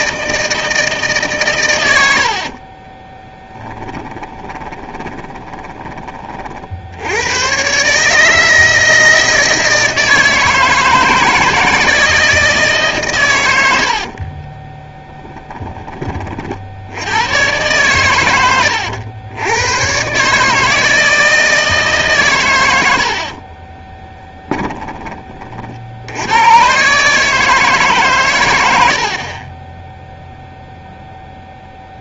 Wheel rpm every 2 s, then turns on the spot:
160, 30, 20, 70, 160, 160, 150, 20, 70, 100, 160, 90, 10, 130, 80, 0.
2-6 14-16